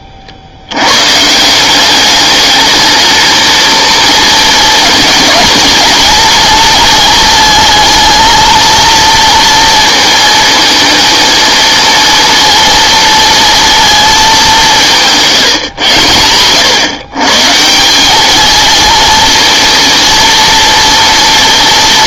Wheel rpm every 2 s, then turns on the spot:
100, 210, 220, 230, 230, 230, 230, 200, 110, 220, 230.
none